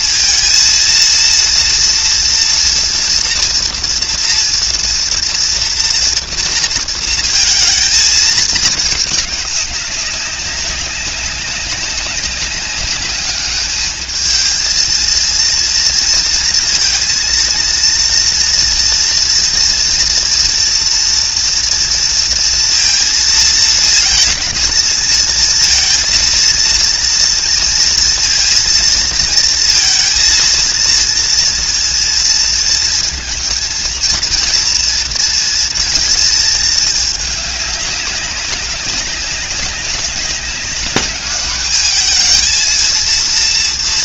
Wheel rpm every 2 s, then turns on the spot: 230, 230, 230, 230, 220, 200, 200, 220, 230, 230, 230, 230, 230, 230, 230, 230, 230, 230, 220, 200, 200, 220.
none